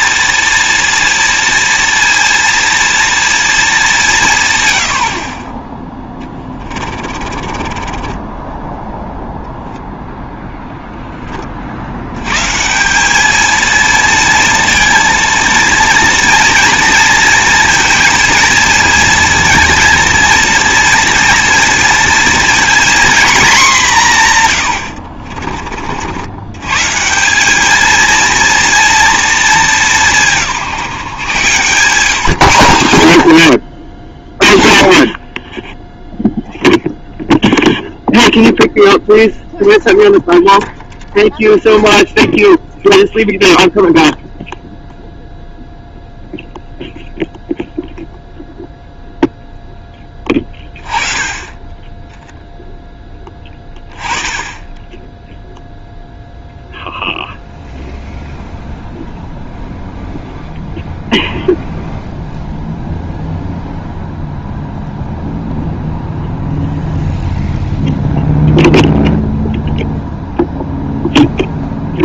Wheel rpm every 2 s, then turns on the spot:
230, 230, 110, 30, 10, 0, 150, 230, 230, 230, 230, 230, 100, 90, 230, 150, 120, 40, 0, 0, 0, 0, 0, 0, 0, 20, 0, 20, 0, 0, 0, 0, 0, 0, 0, 0.
6-10